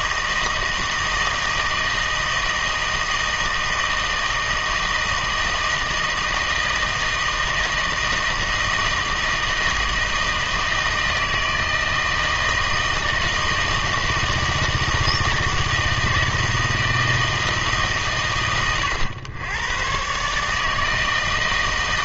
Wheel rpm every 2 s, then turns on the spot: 160, 160, 160, 160, 160, 160, 160, 160, 160, 110, 160.
none